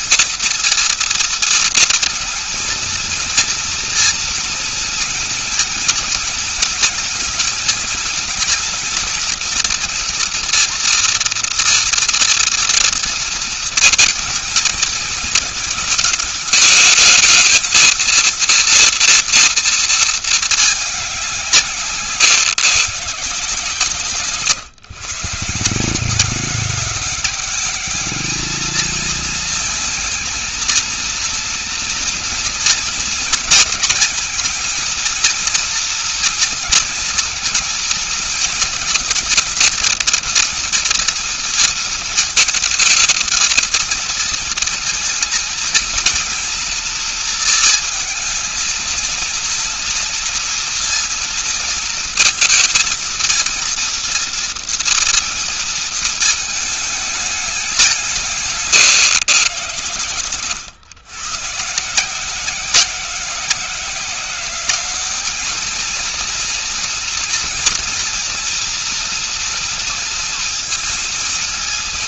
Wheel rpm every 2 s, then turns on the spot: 230, 230, 230, 230, 240, 240, 230, 220, 210, 230, 200, 150, 140, 190, 220, 230, 230, 230, 230, 230, 230, 220, 220, 230, 230, 230, 230, 240, 210, 140, 130, 180, 200, 230, 230, 230.
none